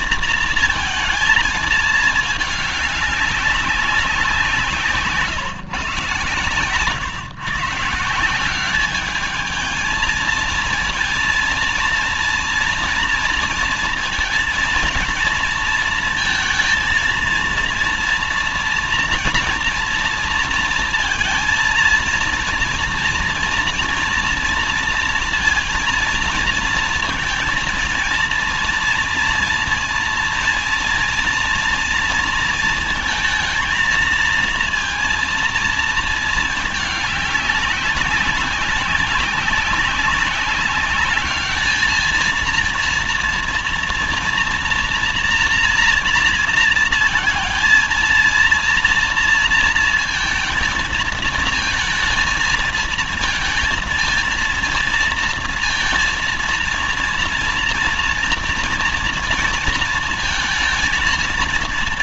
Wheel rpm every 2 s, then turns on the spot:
230, 200, 160, 130, 210, 230, 230, 230, 230, 240, 230, 230, 230, 230, 230, 230, 220, 230, 210, 200, 200, 230, 240, 230, 230, 220, 220, 230, 230, 230, 230.
none